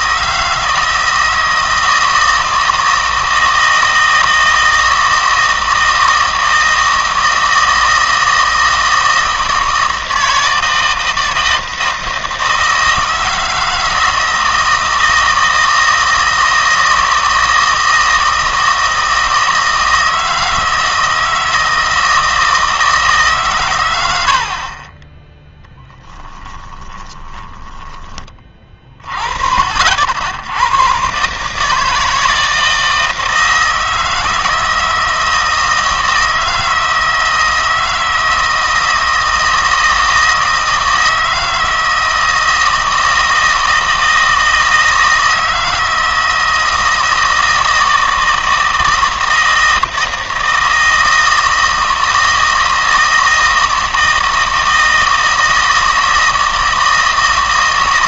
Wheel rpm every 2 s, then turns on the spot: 160, 160, 160, 160, 160, 160, 160, 160, 160, 160, 160, 160, 40, 20, 40, 100, 160, 160, 160, 160, 160, 160, 160, 160, 160, 160, 160, 160, 160.
26-28